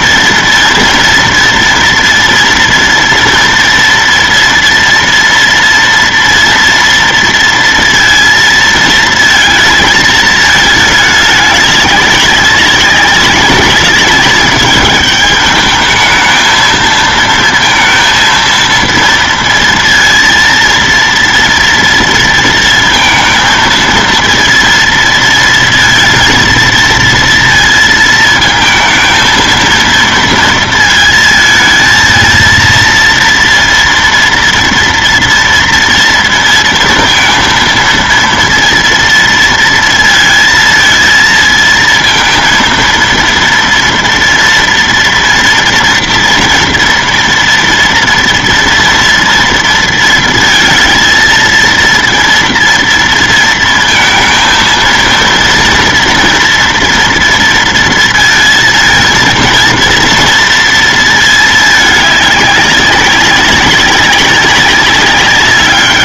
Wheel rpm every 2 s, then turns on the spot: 230, 230, 230, 230, 220, 210, 200, 200, 220, 230, 230, 230, 230, 230, 220, 220, 230, 230, 230, 230, 230, 230, 230, 230, 230, 230, 230, 230, 230, 230, 230, 200, 200.
none